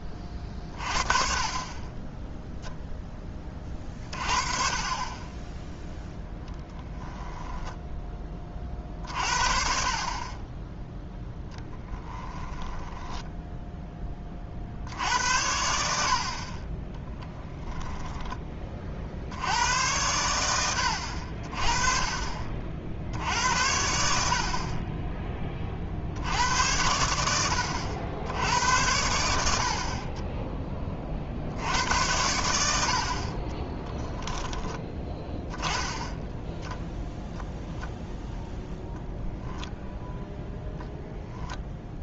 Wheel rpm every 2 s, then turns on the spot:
30, 0, 40, 10, 40, 10, 10, 60, 30, 30, 90, 50, 30, 90, 80, 20, 70, 10, 10, 10, 0.
6-8 12-14 38-40